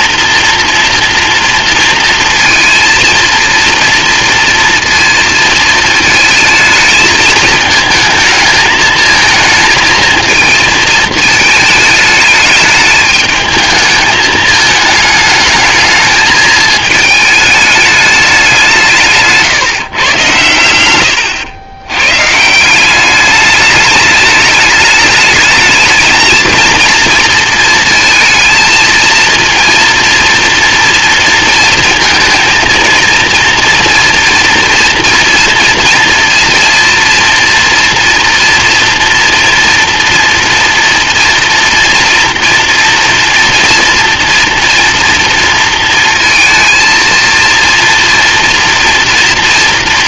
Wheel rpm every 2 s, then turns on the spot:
230, 230, 230, 220, 220, 220, 210, 210, 220, 180, 100, 170, 210, 230, 230, 230, 230, 240, 230, 230, 230, 230, 230, 220, 230.
none